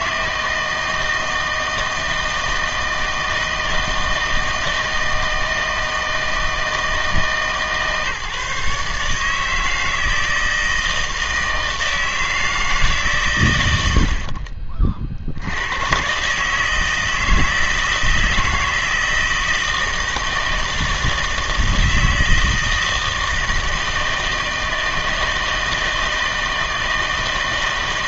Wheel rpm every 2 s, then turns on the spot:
160, 160, 160, 160, 150, 160, 150, 30, 150, 160, 160, 160, 160, 160.
none